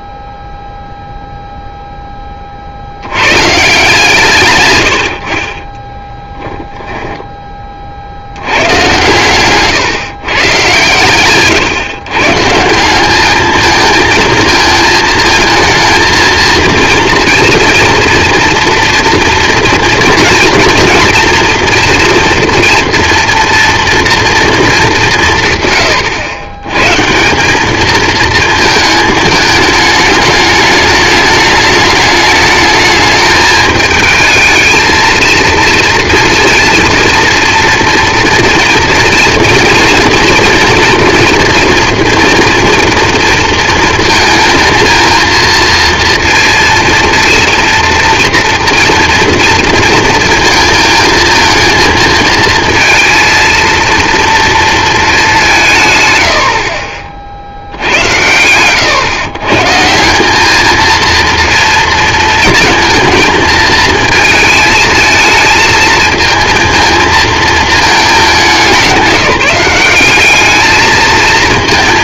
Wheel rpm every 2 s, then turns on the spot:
0, 30, 130, 10, 90, 130, 140, 220, 230, 230, 230, 230, 230, 120, 220, 210, 210, 220, 230, 230, 230, 240, 230, 230, 230, 230, 220, 230, 80, 110, 210, 220, 220, 230, 200, 210.
6-8 56-58